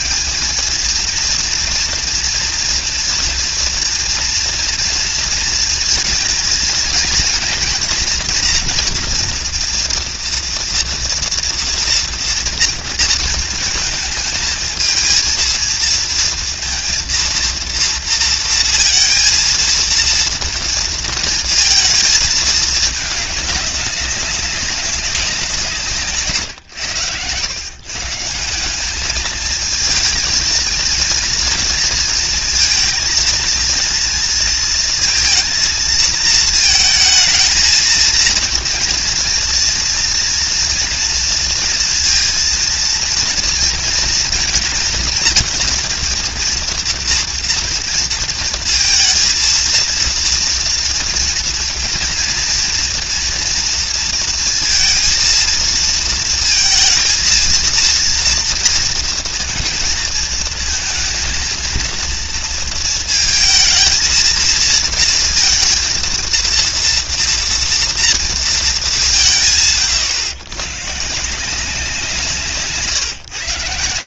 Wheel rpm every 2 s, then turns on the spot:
200, 240, 230, 230, 240, 230, 230, 220, 230, 230, 230, 220, 200, 150, 130, 230, 230, 230, 220, 220, 230, 230, 230, 230, 230, 230, 240, 230, 220, 230, 230, 230, 230, 230, 240, 140, 170.
none